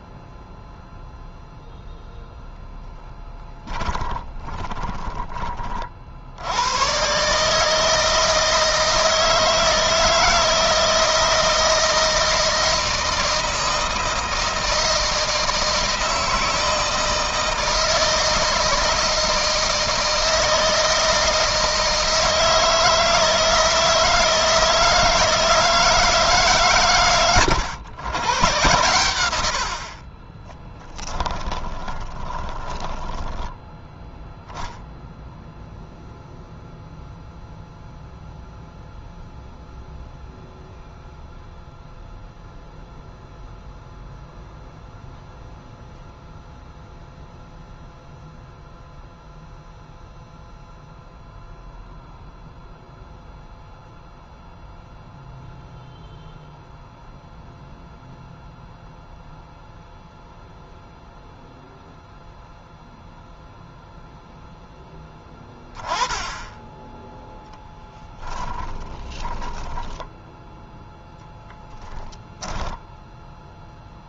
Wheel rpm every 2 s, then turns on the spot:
0, 10, 20, 120, 160, 160, 160, 160, 160, 160, 160, 160, 160, 130, 120, 20, 10, 0, 0, 0, 0, 0, 0, 0, 0, 0, 0, 0, 0, 0, 0, 0, 10, 10, 30, 0, 0.
4-6 30-34 68-70